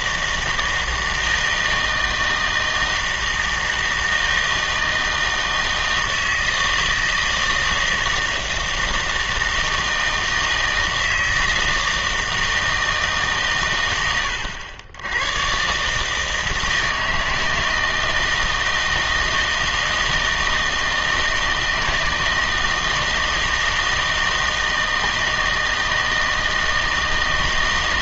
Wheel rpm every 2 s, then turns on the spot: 160, 160, 160, 160, 160, 160, 160, 90, 160, 160, 160, 160, 160, 160.
none